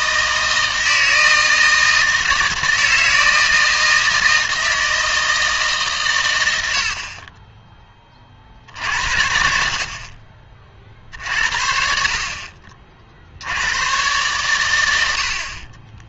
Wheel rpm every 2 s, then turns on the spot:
160, 160, 160, 80, 60, 50, 50, 100.
none